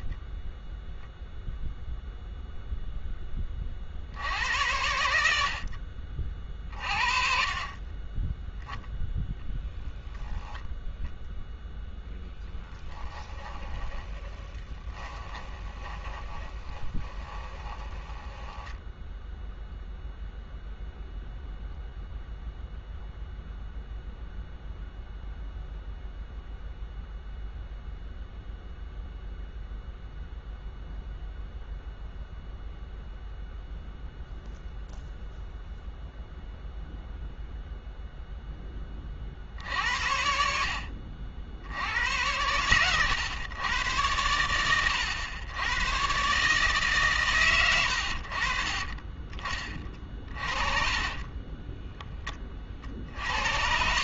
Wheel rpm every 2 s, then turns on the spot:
10, 0, 90, 40, 0, 0, 10, 20, 20, 10, 0, 0, 0, 0, 0, 0, 0, 0, 0, 10, 70, 110, 100, 140, 40, 40, 40.
12-20 50-52